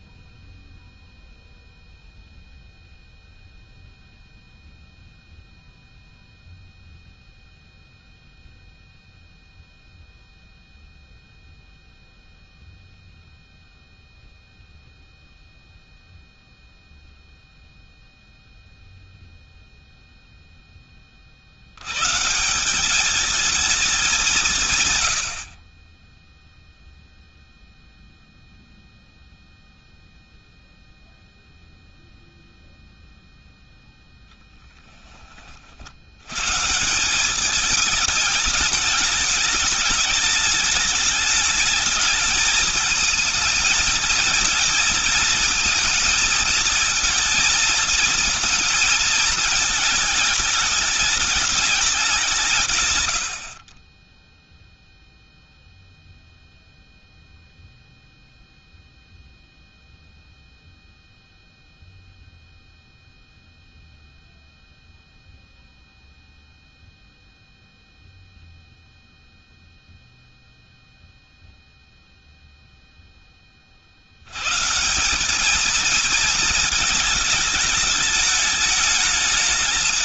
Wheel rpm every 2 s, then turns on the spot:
0, 0, 0, 0, 0, 0, 0, 0, 0, 0, 10, 180, 160, 10, 0, 0, 0, 0, 140, 210, 210, 220, 220, 220, 220, 210, 160, 0, 0, 0, 0, 0, 0, 0, 0, 0, 0, 150, 220, 210.
none